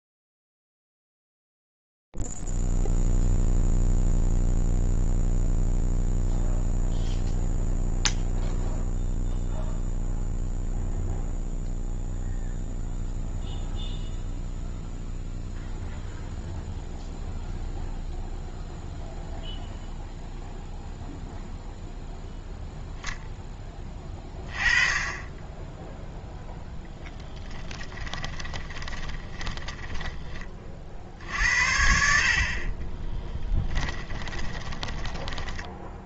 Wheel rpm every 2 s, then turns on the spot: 0, 0, 0, 0, 0, 0, 0, 0, 0, 0, 0, 0, 20, 0, 20, 30, 50, 20.
28-30 34-36